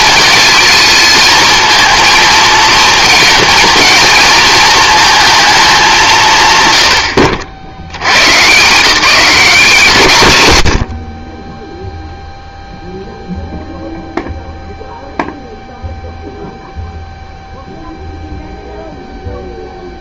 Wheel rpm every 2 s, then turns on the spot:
220, 230, 220, 120, 160, 90, 0, 0, 0, 0.
none